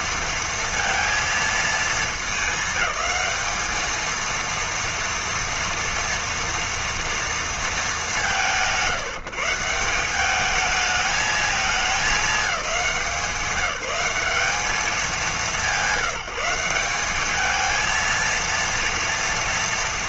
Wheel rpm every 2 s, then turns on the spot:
230, 220, 230, 230, 160, 210, 200, 200, 180, 230.
none